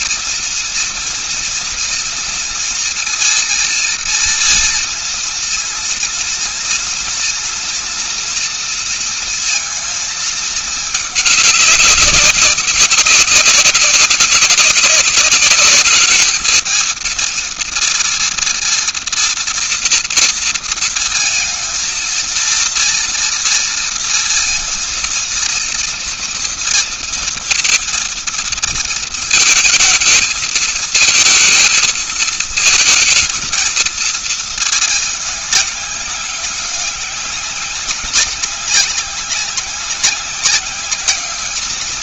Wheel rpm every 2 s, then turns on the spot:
230, 230, 230, 230, 230, 220, 190, 190, 220, 230, 230, 230, 230, 230, 230, 220, 220, 220, 200, 200, 190.
none